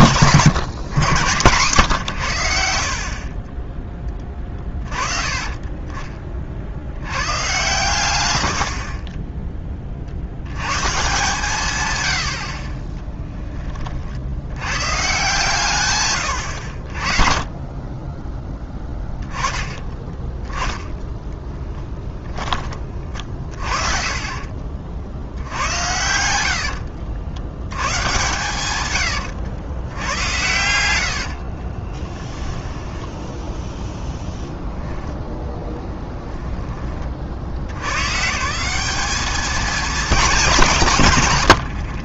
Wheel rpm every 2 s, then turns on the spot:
150, 90, 30, 60, 90, 110, 50, 40, 90, 20, 10, 30, 80, 70, 110, 80, 10, 10, 30, 200, 130.
18-20 32-34